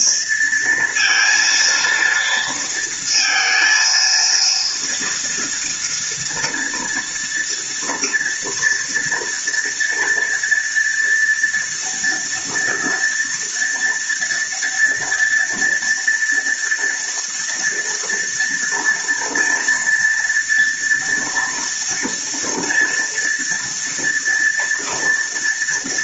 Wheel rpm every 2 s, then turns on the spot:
230, 230, 230, 230, 230, 230, 230, 230, 230, 230, 240, 240, 230.
none